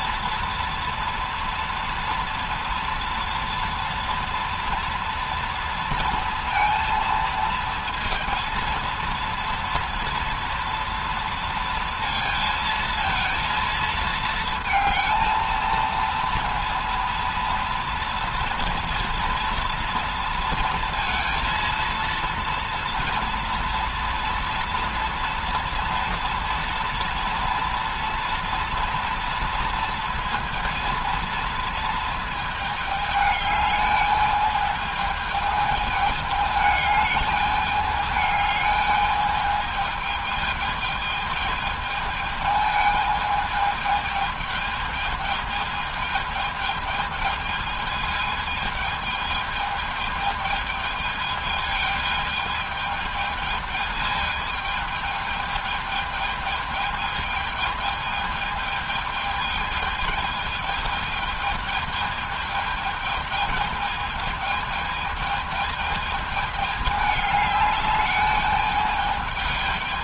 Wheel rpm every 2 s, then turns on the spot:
240, 230, 230, 230, 230, 230, 220, 230, 230, 230, 230, 240, 240, 230, 230, 230, 210, 210, 210, 210, 220, 220, 220, 220, 220, 210, 220, 220, 220, 220, 220, 220, 220, 210, 210.
none